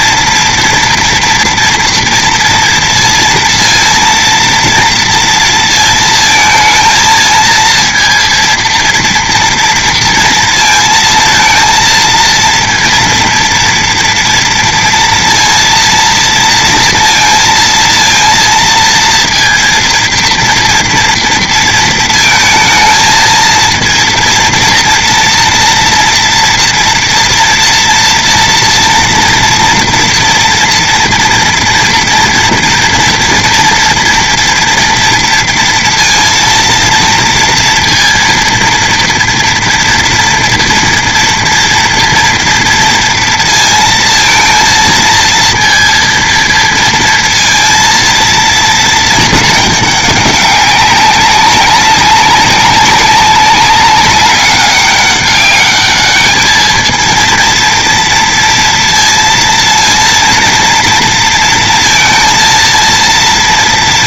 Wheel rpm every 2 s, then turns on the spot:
230, 230, 230, 230, 230, 230, 230, 230, 230, 230, 230, 220, 230, 240, 230, 230, 230, 230, 230, 230, 230, 230, 230, 230, 230, 200, 200, 200, 220, 230, 230, 230.
none